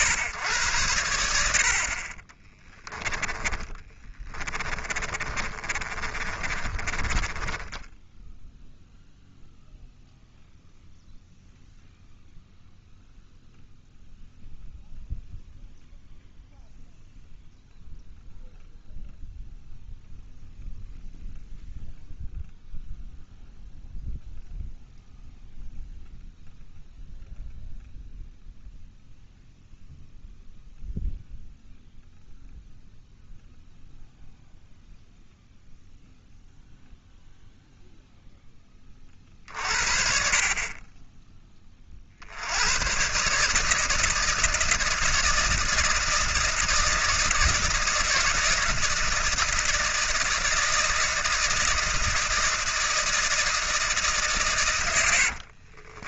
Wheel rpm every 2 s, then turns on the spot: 90, 20, 30, 20, 0, 0, 0, 0, 0, 0, 0, 0, 0, 0, 0, 0, 0, 0, 0, 20, 30, 110, 160, 160, 160, 160, 160, 110.
2-8 54-56